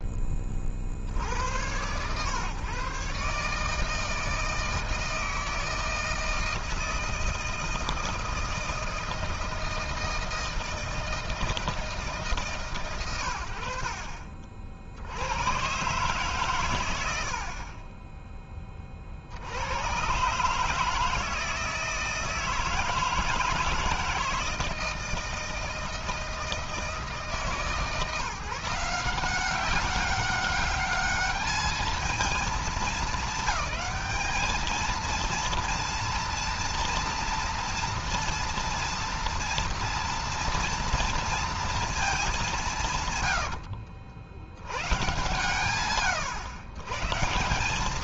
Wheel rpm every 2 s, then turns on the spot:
20, 120, 160, 160, 160, 160, 150, 60, 140, 20, 140, 160, 160, 160, 150, 200, 220, 220, 230, 230, 230, 200, 90, 100.
none